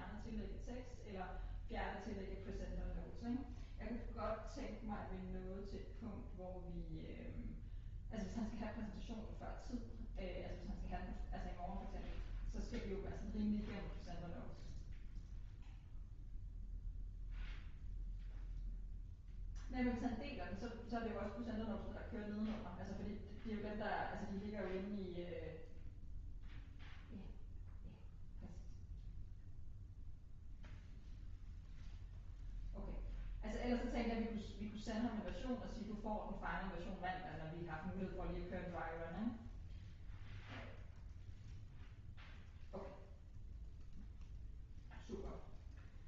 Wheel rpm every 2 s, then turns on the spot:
0, 0, 0, 0, 0, 0, 0, 0, 0, 0, 0, 0, 0, 0, 0, 0, 0, 0, 0, 0, 0, 0, 0.
none